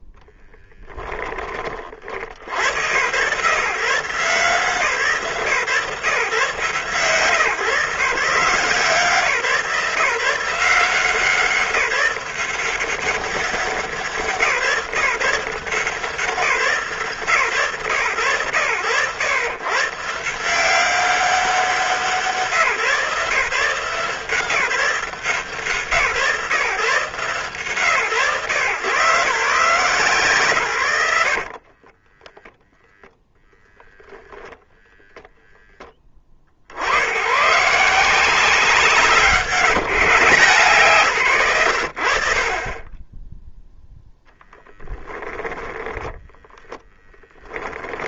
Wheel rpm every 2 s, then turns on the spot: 0, 60, 150, 140, 140, 170, 180, 170, 150, 100, 160, 160, 170, 130, 130, 130, 0, 0, 30, 170, 150, 30, 10, 10.
46-48